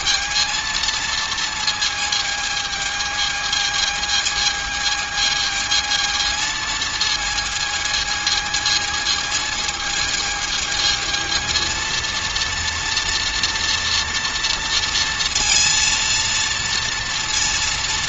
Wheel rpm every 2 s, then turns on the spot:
230, 220, 220, 220, 220, 220, 240, 230, 240.
none